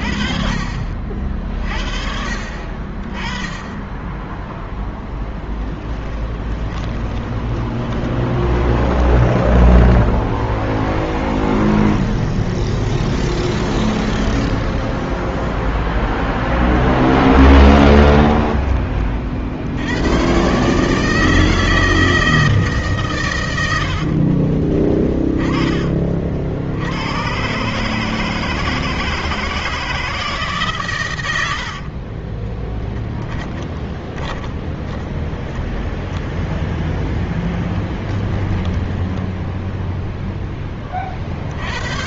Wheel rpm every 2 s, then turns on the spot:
50, 40, 0, 20, 20, 0, 20, 0, 10, 20, 130, 150, 30, 60, 160, 150, 20, 20, 10, 20, 10.
6-10 12-14 16-18 24-26 32-36 38-40